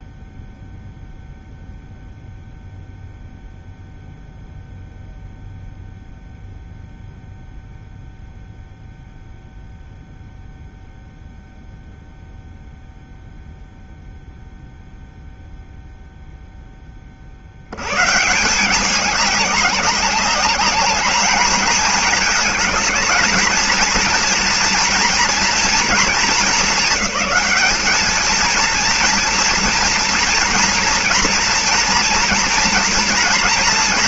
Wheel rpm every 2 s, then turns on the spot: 0, 0, 0, 0, 0, 0, 0, 0, 10, 170, 200, 210, 230, 220, 230, 230, 230.
none